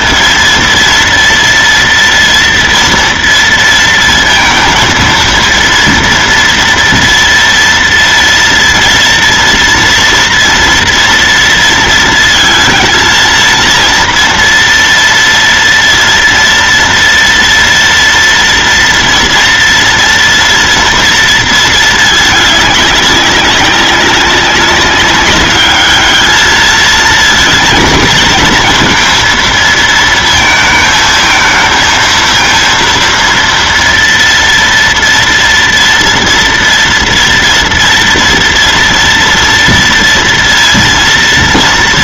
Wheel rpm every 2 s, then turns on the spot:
230, 230, 230, 230, 230, 230, 220, 230, 230, 230, 230, 210, 200, 220, 230, 220, 230, 230, 230, 230, 230.
none